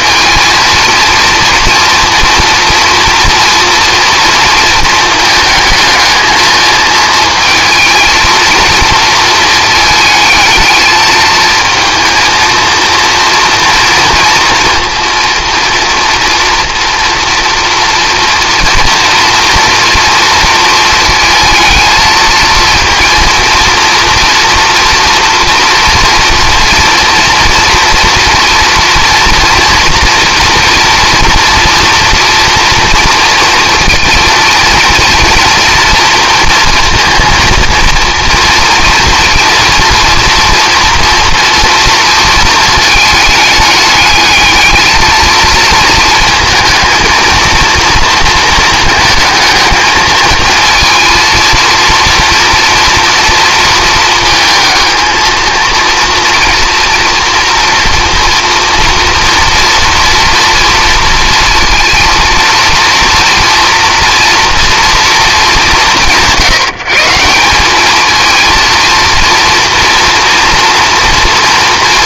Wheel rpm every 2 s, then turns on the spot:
220, 240, 230, 220, 230, 220, 230, 230, 230, 230, 230, 220, 230, 240, 230, 240, 230, 230, 230, 230, 230, 220, 210, 230, 230, 220, 230, 220, 230, 230, 230, 230, 240, 160, 220, 230.
none